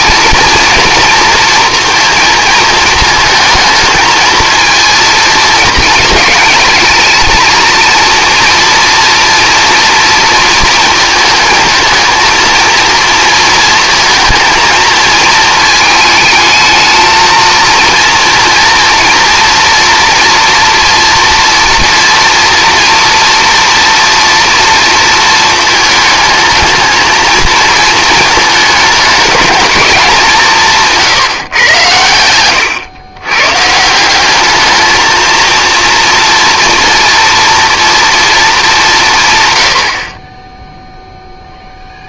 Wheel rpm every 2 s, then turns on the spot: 230, 230, 220, 210, 240, 230, 230, 220, 220, 230, 230, 240, 240, 220, 220, 170, 110, 210, 230, 200, 10.
none